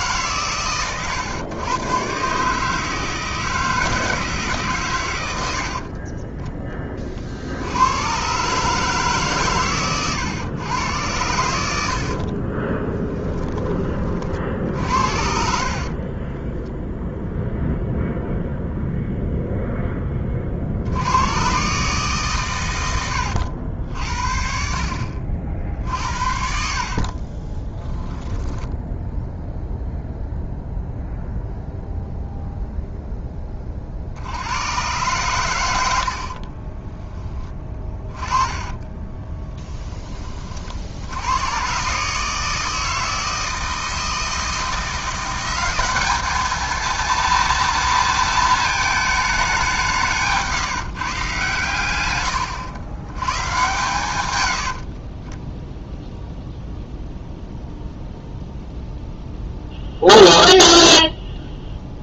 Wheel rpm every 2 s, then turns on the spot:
120, 160, 120, 30, 150, 110, 20, 60, 0, 0, 80, 100, 60, 40, 0, 0, 0, 110, 20, 20, 70, 160, 170, 230, 220, 150, 100, 60, 0, 0, 0.
12-16 26-28 36-40 54-56